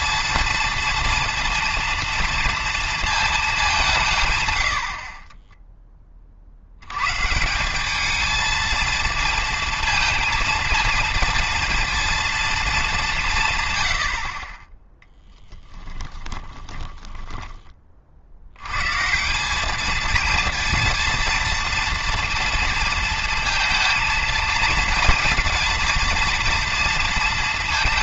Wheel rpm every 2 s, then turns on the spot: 230, 230, 70, 110, 230, 230, 200, 10, 20, 130, 230, 230, 230, 230.
16-18